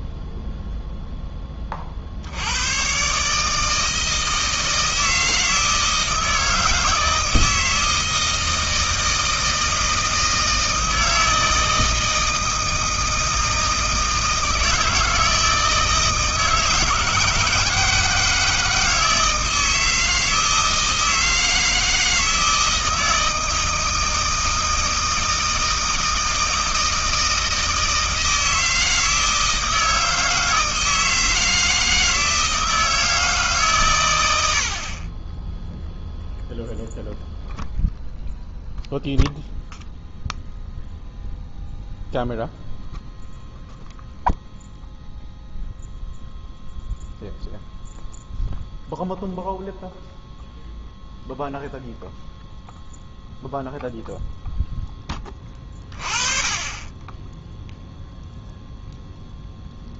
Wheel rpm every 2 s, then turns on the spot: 0, 110, 160, 160, 160, 160, 160, 160, 160, 160, 160, 160, 160, 160, 160, 160, 160, 60, 0, 0, 0, 0, 0, 0, 0, 0, 0, 10, 20, 0.
none